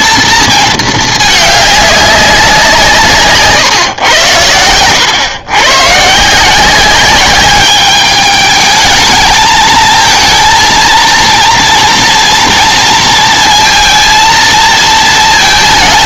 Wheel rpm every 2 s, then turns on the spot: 230, 180, 100, 170, 210, 230, 230, 230.
none